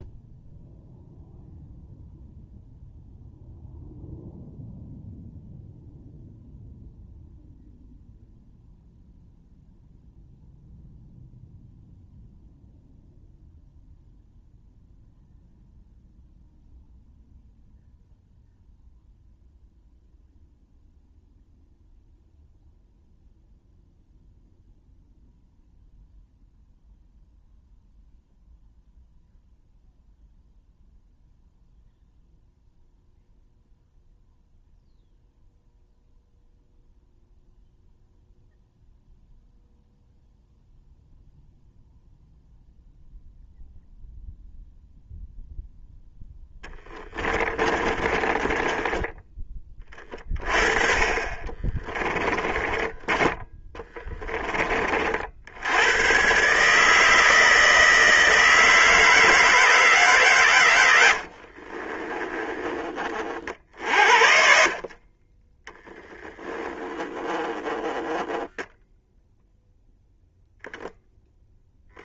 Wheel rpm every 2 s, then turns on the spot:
0, 0, 0, 0, 0, 0, 0, 0, 0, 0, 0, 0, 0, 0, 0, 0, 0, 0, 0, 0, 0, 0, 0, 10, 20, 30, 20, 40, 150, 160, 110, 30, 50, 10, 0, 0.
46-50 52-54 60-62 64-66